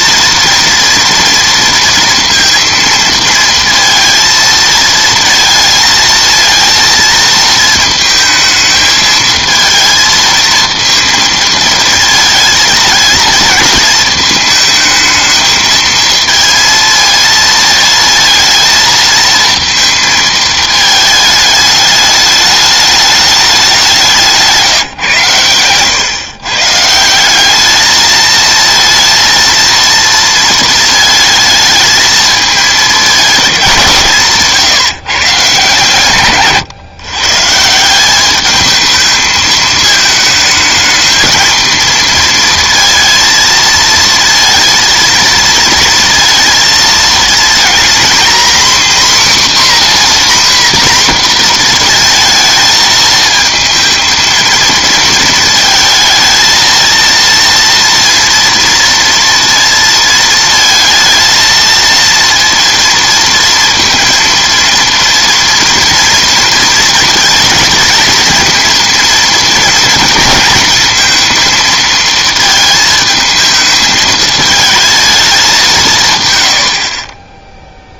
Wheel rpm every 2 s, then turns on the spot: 230, 230, 230, 230, 220, 230, 220, 220, 230, 220, 220, 210, 170, 150, 230, 220, 210, 150, 140, 210, 220, 230, 230, 230, 260, 250, 220, 220, 220, 230, 220, 230, 230, 230, 230, 220, 220, 220, 80.
none